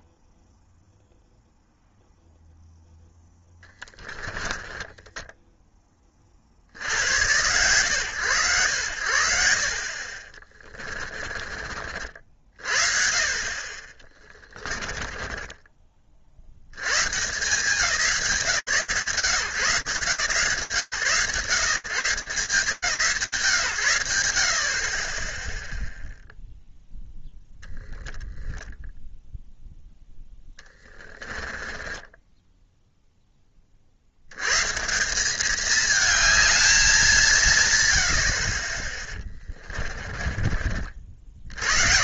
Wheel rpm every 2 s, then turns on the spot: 0, 0, 10, 60, 90, 30, 40, 20, 90, 130, 140, 150, 40, 0, 0, 20, 10, 180, 200, 20, 60.
10-12 14-16 30-32